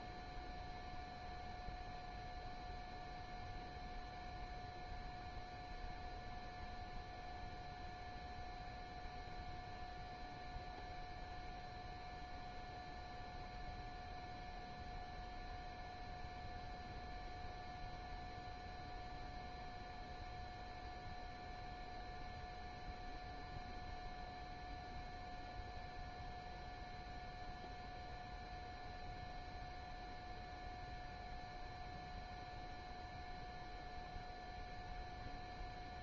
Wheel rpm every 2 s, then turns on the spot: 0, 0, 0, 0, 0, 0, 0, 0, 0, 0, 0, 0, 0, 0, 0, 0, 0, 0.
none